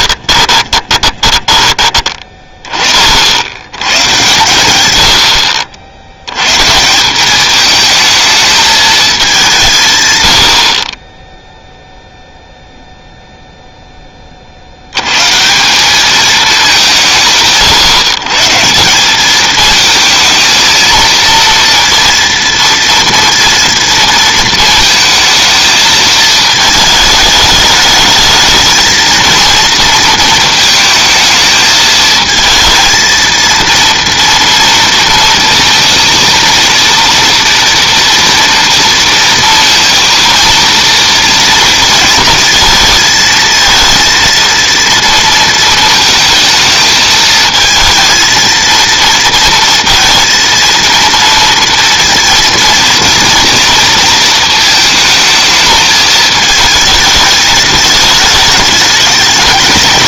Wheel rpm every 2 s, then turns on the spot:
20, 20, 120, 150, 220, 50, 0, 70, 190, 160, 230, 230, 220, 220, 220, 220, 220, 230, 230, 230, 230, 220, 230, 220, 230, 230, 230, 220, 220, 210.
0-2